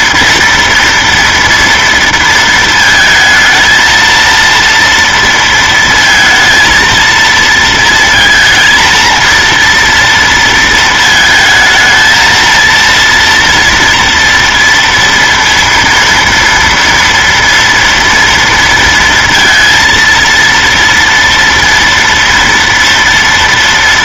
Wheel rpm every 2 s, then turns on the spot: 230, 220, 230, 230, 230, 230, 230, 230, 230, 230, 230, 230.
none